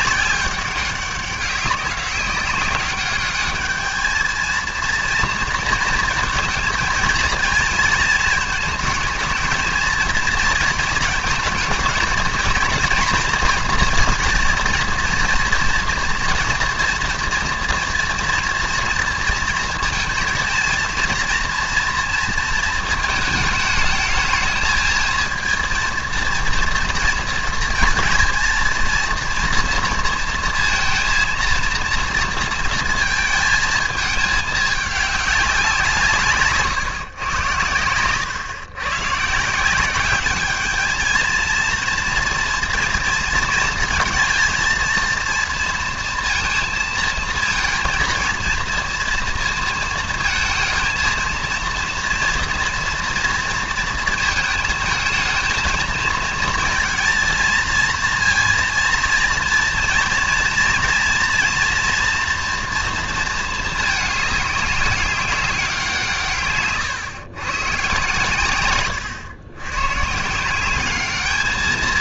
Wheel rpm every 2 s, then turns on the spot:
190, 190, 230, 230, 220, 220, 230, 230, 230, 240, 230, 230, 220, 230, 230, 230, 230, 210, 150, 130, 210, 230, 220, 230, 230, 220, 240, 220, 230, 230, 230, 240, 200, 130, 120, 190.
none